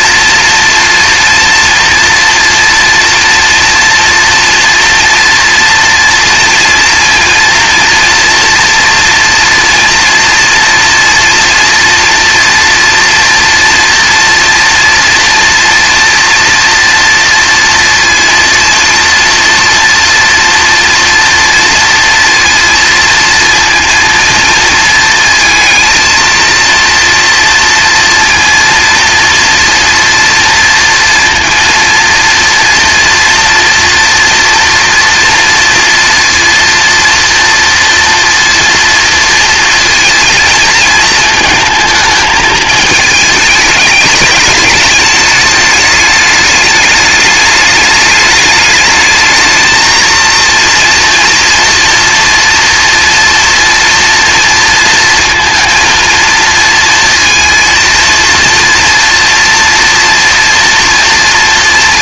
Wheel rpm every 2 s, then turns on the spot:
240, 230, 230, 230, 230, 230, 230, 230, 230, 230, 230, 230, 230, 230, 230, 230, 230, 230, 230, 240, 230, 220, 210, 210, 210, 230, 230, 230, 220, 230, 230.
none